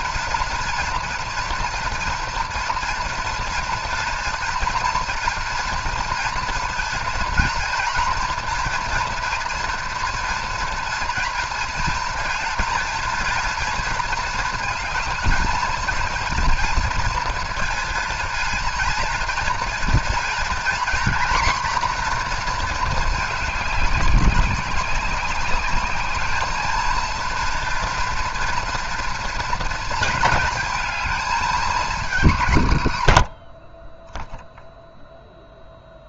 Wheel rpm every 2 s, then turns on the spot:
230, 230, 230, 230, 230, 230, 230, 230, 230, 230, 230, 240, 190, 220, 230, 220, 150, 0.
none